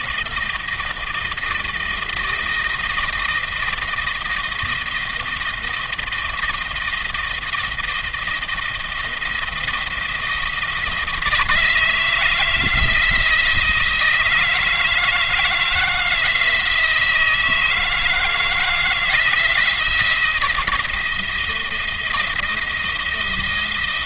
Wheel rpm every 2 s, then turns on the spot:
160, 160, 160, 160, 170, 160, 170, 160, 160, 160, 160, 170.
none